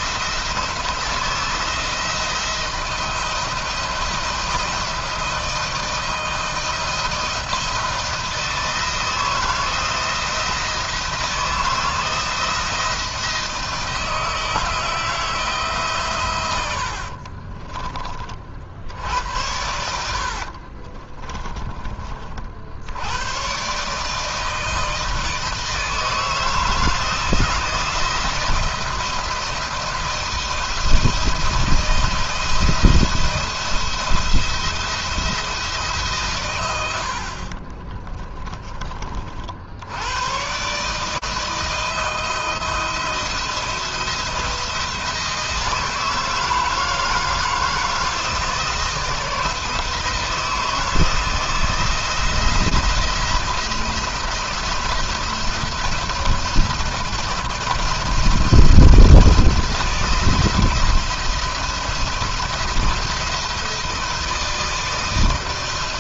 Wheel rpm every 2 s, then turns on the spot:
160, 170, 170, 160, 160, 170, 160, 160, 60, 70, 40, 90, 160, 160, 160, 170, 170, 170, 80, 30, 150, 160, 160, 160, 160, 160, 170, 170, 160, 170, 170, 170, 160.
16-18 20-22 36-38